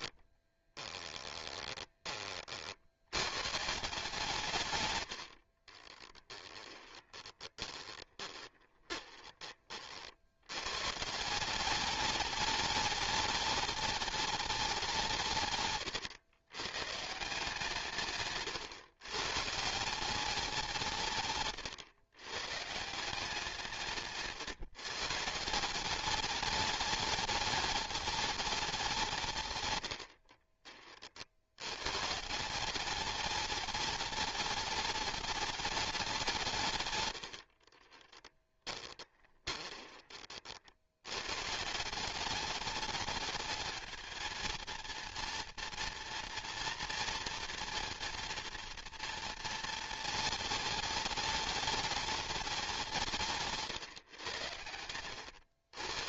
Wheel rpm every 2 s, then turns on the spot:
10, 60, 110, 20, 20, 110, 210, 200, 120, 130, 180, 150, 150, 210, 200, 40, 190, 210, 130, 20, 70, 200, 230, 240, 230, 210, 190, 100.
0-2 6-10 38-40